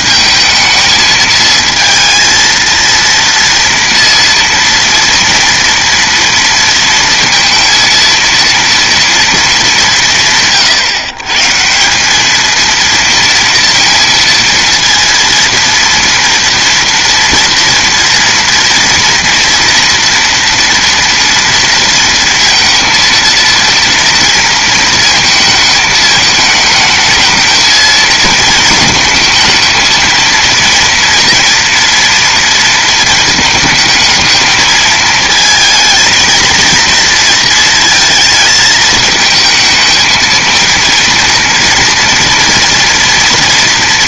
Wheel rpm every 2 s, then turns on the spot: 220, 230, 230, 230, 230, 140, 230, 230, 230, 230, 230, 230, 230, 220, 220, 230, 230, 220, 230, 220, 230, 230.
none